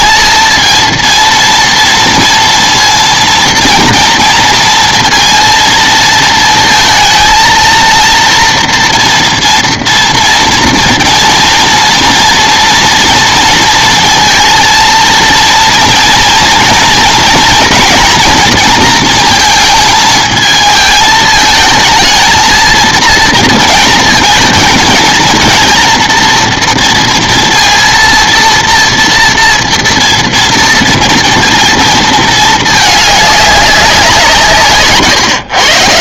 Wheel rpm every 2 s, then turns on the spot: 230, 230, 230, 230, 230, 230, 230, 230, 230, 230, 220, 230, 220, 230, 230, 230, 210, 150.
34-36